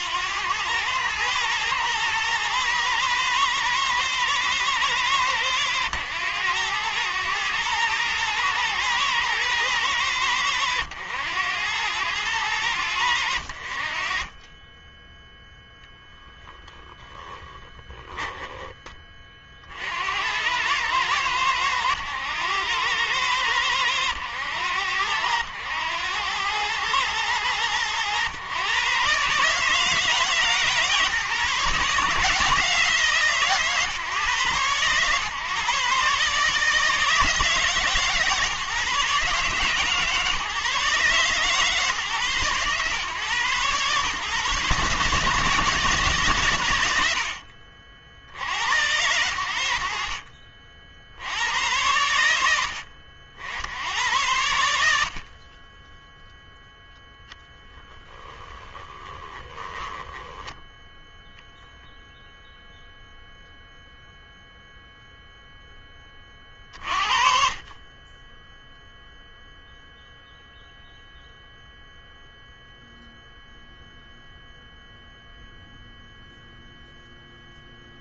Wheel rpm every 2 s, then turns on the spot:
100, 110, 100, 100, 110, 90, 80, 10, 10, 20, 100, 100, 90, 110, 130, 150, 150, 120, 150, 140, 140, 130, 140, 110, 90, 70, 70, 80, 0, 30, 0, 0, 0, 40, 0, 0, 0, 0, 0.
58-60